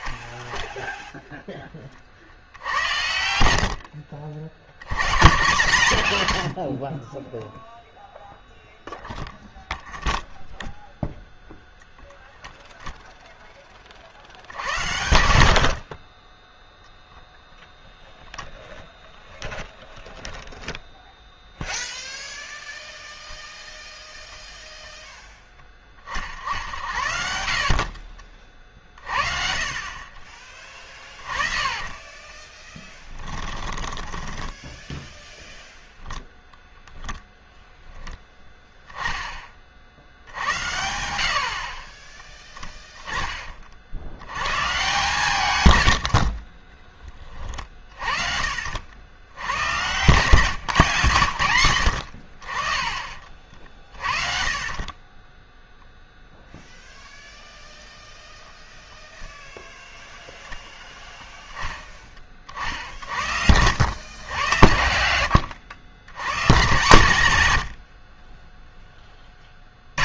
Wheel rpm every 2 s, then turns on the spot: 0, 70, 100, 60, 0, 0, 0, 100, 0, 0, 0, 0, 10, 60, 40, 20, 10, 10, 0, 10, 90, 20, 130, 30, 70, 140, 30, 20, 0, 0, 0, 60, 90, 120, 10.
2-4 30-36 50-52